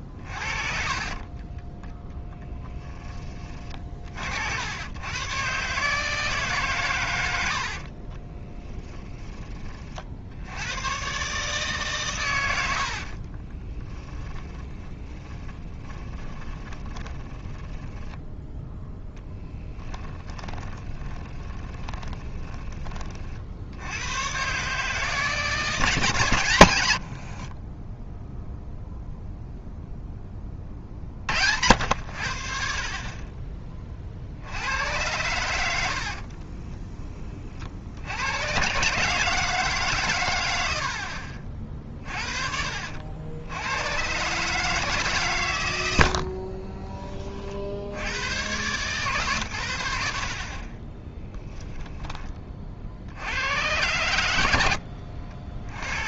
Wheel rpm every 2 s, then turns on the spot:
40, 30, 110, 120, 10, 120, 60, 20, 30, 0, 20, 30, 150, 90, 0, 60, 50, 90, 10, 130, 60, 70, 150, 20, 130, 30, 60, 70.
0-2 12-18 20-22 26-28 50-52 54-56